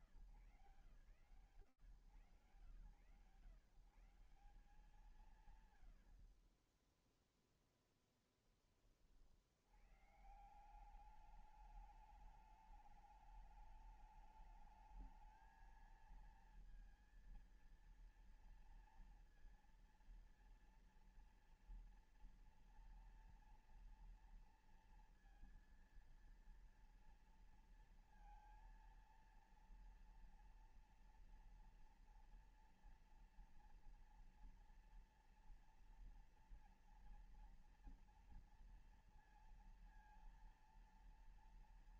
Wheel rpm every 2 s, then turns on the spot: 110, 130, 140, 0, 30, 180, 210, 220, 230, 230, 230, 230, 230, 230, 230, 230, 240, 230, 240, 230, 230.
none